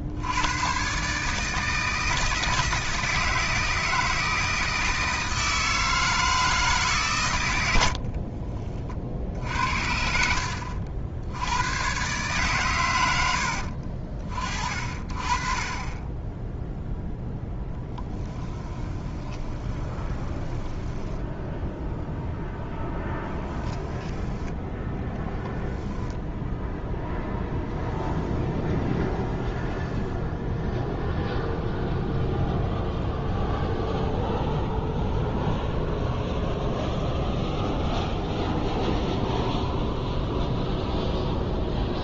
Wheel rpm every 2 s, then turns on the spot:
110, 160, 160, 160, 30, 60, 120, 40, 0, 20, 10, 10, 10, 0, 0, 0, 0, 0, 0, 0, 0.
18-22